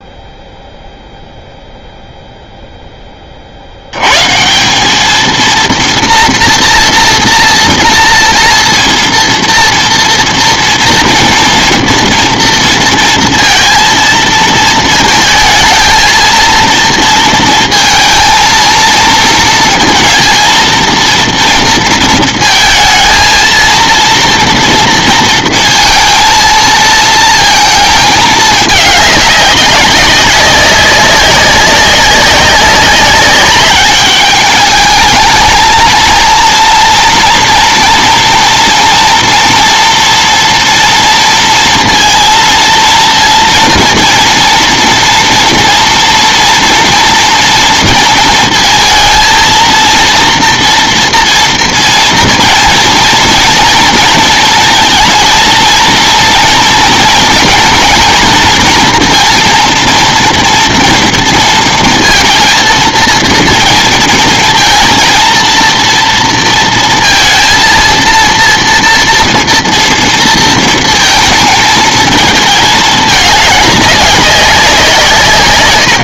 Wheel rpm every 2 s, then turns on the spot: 0, 0, 170, 240, 230, 230, 230, 220, 230, 230, 230, 220, 230, 230, 210, 190, 190, 210, 230, 230, 230, 230, 230, 230, 230, 230, 230, 230, 230, 230, 230, 230, 230, 230, 230, 230, 220, 180.
none